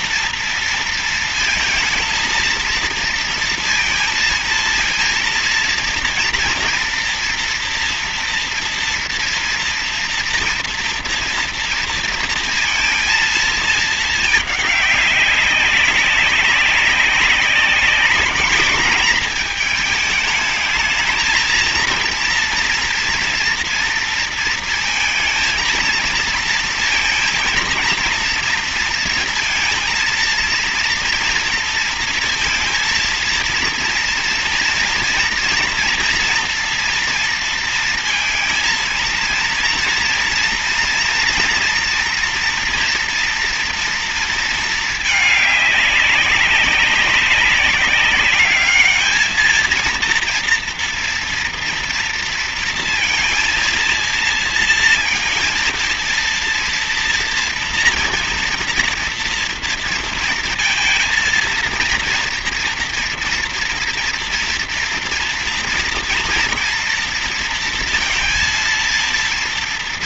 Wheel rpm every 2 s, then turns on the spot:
230, 230, 230, 230, 230, 230, 230, 210, 190, 210, 210, 230, 230, 230, 230, 230, 230, 230, 230, 230, 230, 230, 230, 200, 210, 230, 230, 230, 230, 230, 230, 230, 230, 230, 230.
none